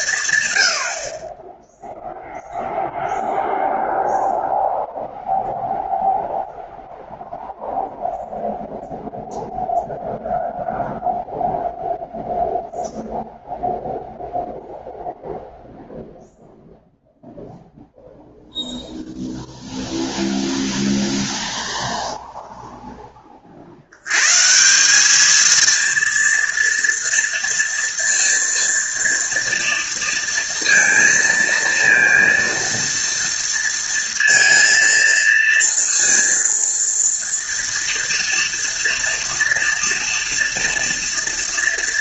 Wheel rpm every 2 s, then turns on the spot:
70, 0, 0, 0, 0, 0, 0, 0, 0, 0, 0, 10, 190, 230, 230, 230, 230, 230, 230, 230, 240.
none